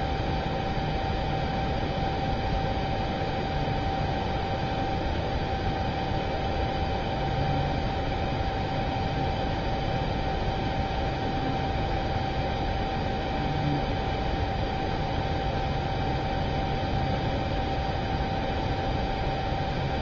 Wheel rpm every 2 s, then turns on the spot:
0, 0, 0, 0, 0, 0, 0, 0, 0, 0.
none